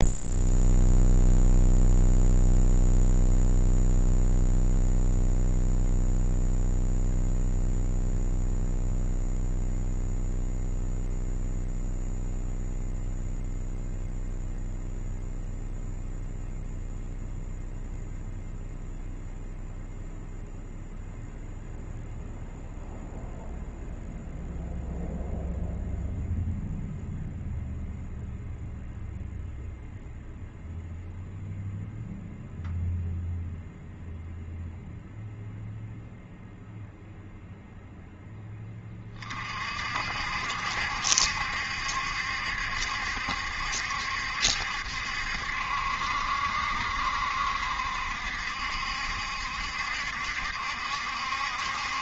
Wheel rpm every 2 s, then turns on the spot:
0, 0, 0, 0, 0, 0, 0, 0, 0, 0, 0, 0, 0, 0, 0, 0, 0, 0, 0, 20, 70, 70, 70, 70, 70, 70.
none